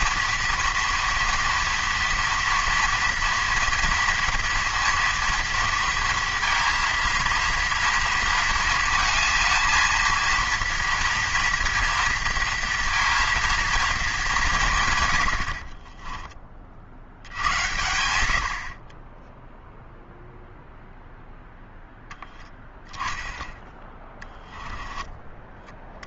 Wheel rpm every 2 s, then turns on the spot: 230, 240, 230, 230, 230, 230, 230, 160, 30, 60, 0, 0, 10.
24-26